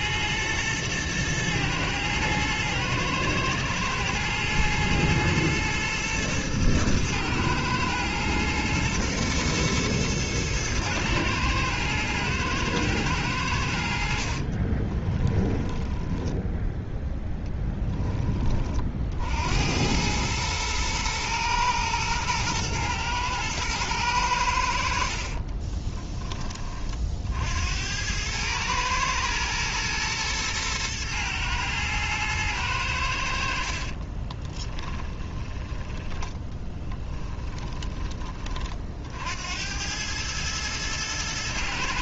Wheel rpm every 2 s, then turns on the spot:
110, 110, 110, 110, 120, 110, 110, 30, 10, 40, 110, 110, 80, 30, 110, 110, 100, 20, 20, 50, 110.
14-16 34-38